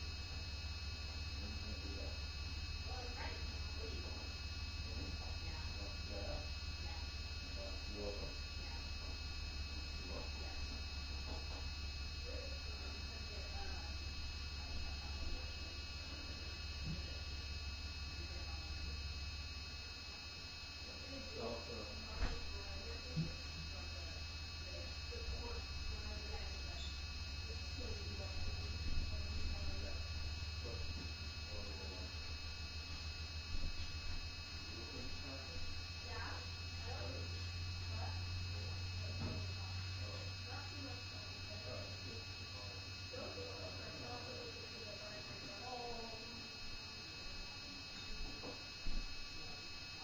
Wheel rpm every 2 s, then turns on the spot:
0, 0, 0, 0, 0, 0, 0, 0, 0, 0, 0, 0, 0, 0, 0, 0, 0, 0, 0, 0, 0, 0, 0, 0, 0.
none